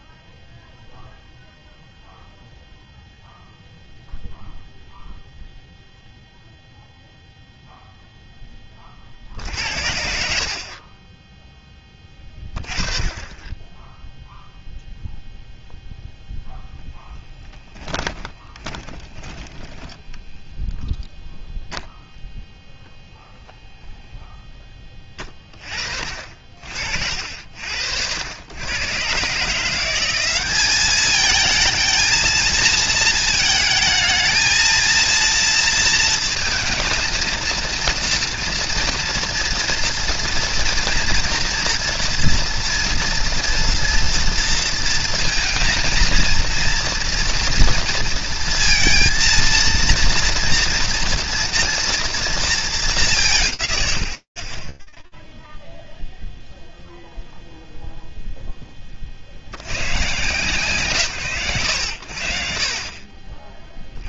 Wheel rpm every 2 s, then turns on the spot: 0, 0, 0, 0, 10, 50, 20, 0, 0, 10, 10, 0, 10, 50, 100, 190, 230, 220, 230, 230, 230, 240, 230, 230, 230, 240, 240, 30, 0, 30, 130, 50.
10-12 18-20